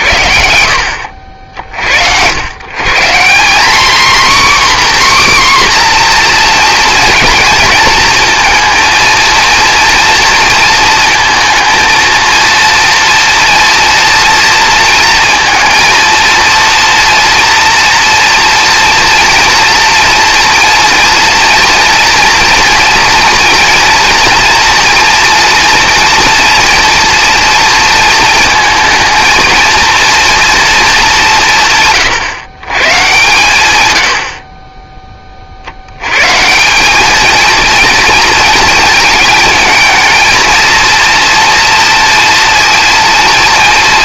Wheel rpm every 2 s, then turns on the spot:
50, 240, 260, 220, 230, 230, 230, 230, 230, 230, 240, 240, 230, 230, 230, 140, 110, 70, 230, 220, 230, 230.
none